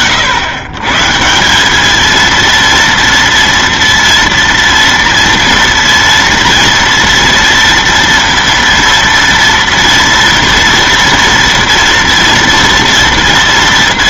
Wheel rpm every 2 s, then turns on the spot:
110, 230, 230, 230, 230, 230, 230.
none